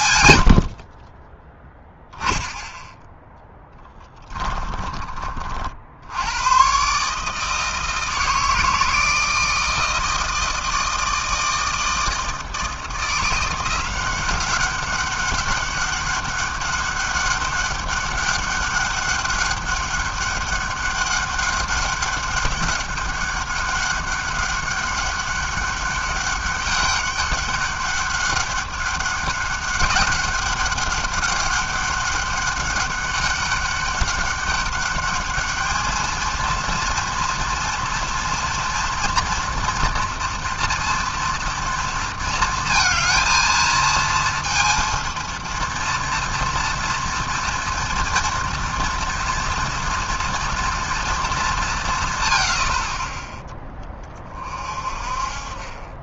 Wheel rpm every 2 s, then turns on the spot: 60, 0, 20, 130, 160, 160, 170, 190, 200, 200, 200, 200, 200, 200, 200, 200, 200, 200, 230, 230, 230, 220, 230, 230, 230, 240, 70, 40.
none